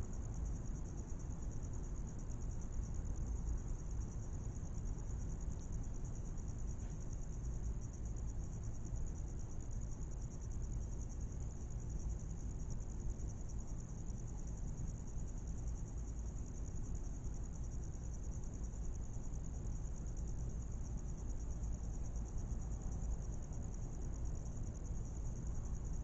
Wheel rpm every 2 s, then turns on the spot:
0, 0, 0, 0, 0, 0, 0, 0, 0, 0, 0, 0, 0.
none